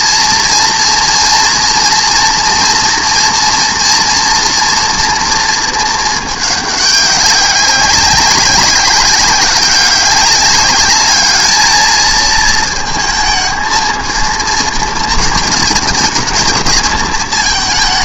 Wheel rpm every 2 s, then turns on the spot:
230, 230, 230, 210, 200, 200, 220, 220, 220.
none